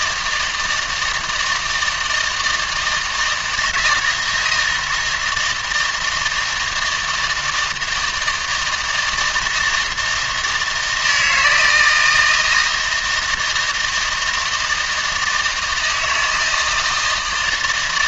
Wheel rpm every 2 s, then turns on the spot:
160, 160, 160, 160, 160, 160, 160, 160, 160.
none